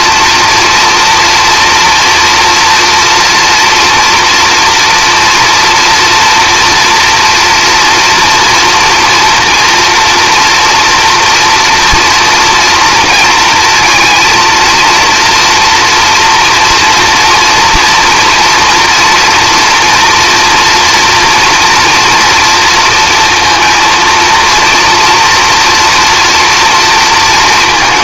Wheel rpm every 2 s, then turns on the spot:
230, 230, 240, 230, 230, 240, 230, 230, 230, 230, 230, 230, 230, 230.
none